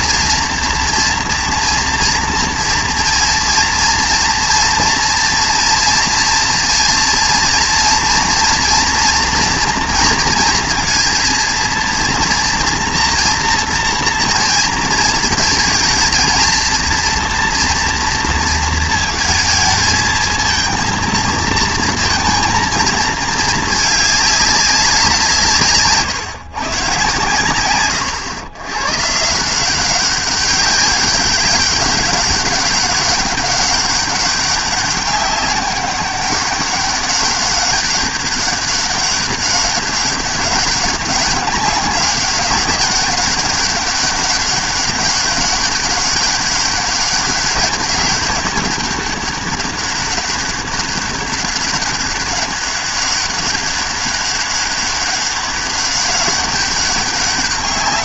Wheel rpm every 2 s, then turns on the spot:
230, 230, 230, 230, 230, 230, 230, 230, 220, 230, 220, 230, 200, 140, 120, 190, 200, 200, 200, 200, 190, 200, 200, 200, 200, 200, 200, 200, 200.
none